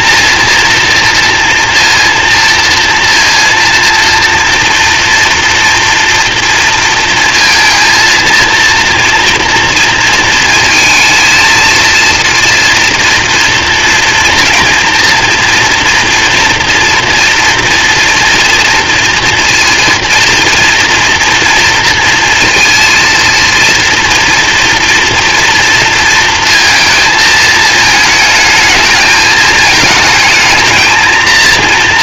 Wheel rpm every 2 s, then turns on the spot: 230, 230, 230, 230, 230, 230, 230, 230, 230, 230, 230, 230, 230, 230, 220, 220.
none